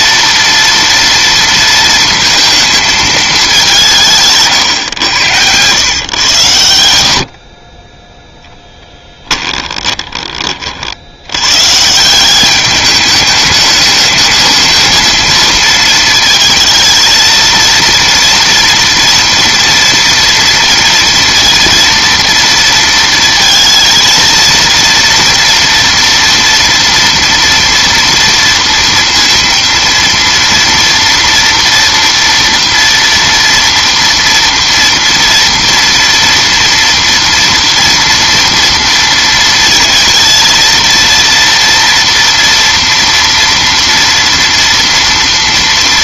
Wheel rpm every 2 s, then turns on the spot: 230, 230, 130, 90, 10, 50, 200, 220, 220, 230, 230, 230, 230, 230, 230, 230, 230, 230, 230, 230, 230, 230, 230.
8-10